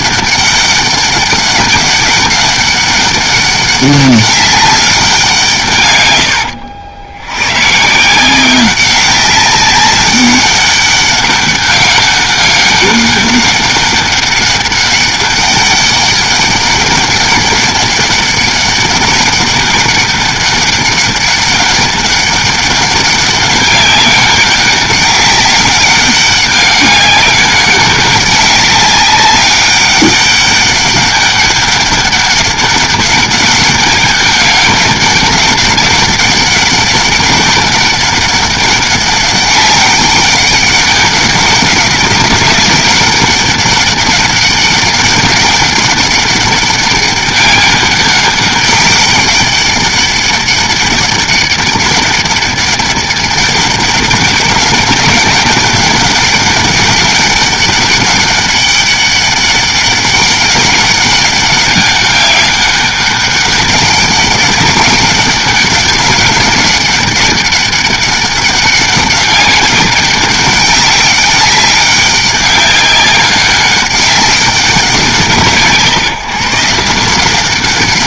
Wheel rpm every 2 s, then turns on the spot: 200, 200, 200, 80, 180, 200, 200, 200, 200, 200, 200, 200, 190, 200, 200, 200, 200, 200, 200, 200, 200, 190, 200, 200, 200, 200, 200, 200, 200, 200, 200, 200, 190, 200, 200, 200, 200, 180, 150.
none